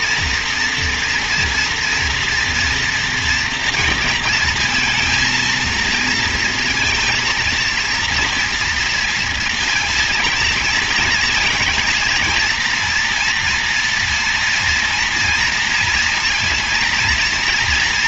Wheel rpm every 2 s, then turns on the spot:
230, 230, 220, 230, 230, 230, 230, 230, 230.
none